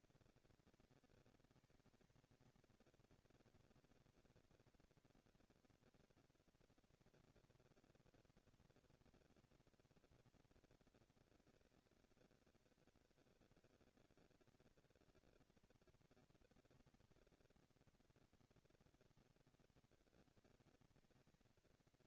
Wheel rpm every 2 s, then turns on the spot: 220, 230, 230, 230, 240, 230, 230, 230, 230, 230, 230.
none